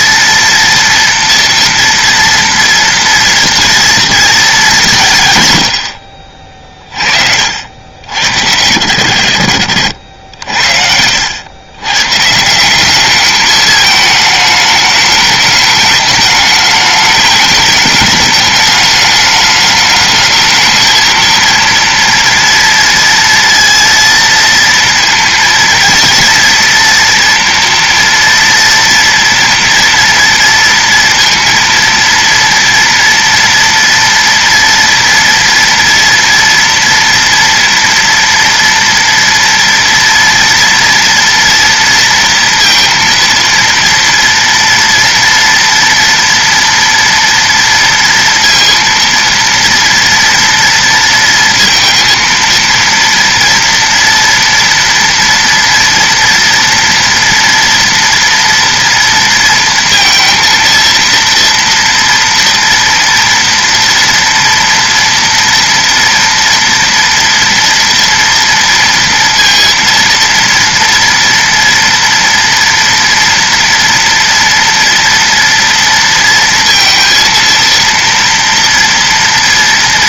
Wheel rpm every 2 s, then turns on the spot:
230, 230, 190, 30, 80, 70, 180, 210, 210, 210, 220, 230, 230, 230, 230, 230, 240, 230, 230, 230, 230, 230, 230, 230, 230, 230, 230, 240, 230, 230, 230, 240, 230, 230, 230, 230, 230, 230, 230, 230.
none